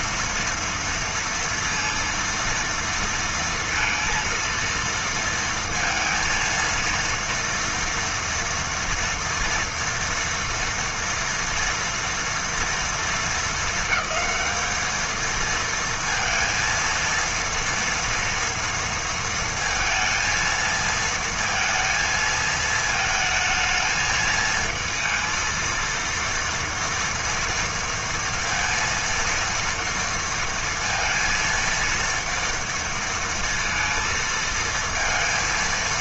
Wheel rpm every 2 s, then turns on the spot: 230, 230, 230, 230, 230, 230, 230, 220, 230, 230, 230, 220, 220, 230, 230, 230, 230, 230.
none